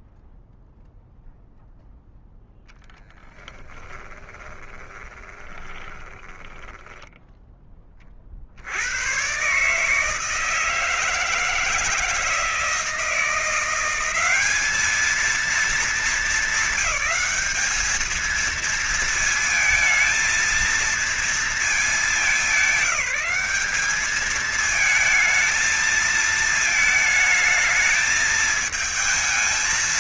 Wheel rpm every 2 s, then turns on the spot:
0, 0, 20, 20, 40, 150, 160, 190, 220, 220, 220, 200, 210, 220, 220.
4-8